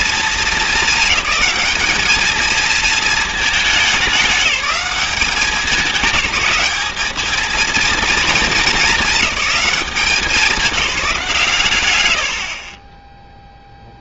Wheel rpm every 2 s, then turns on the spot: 210, 220, 200, 200, 210, 200, 40.
12-14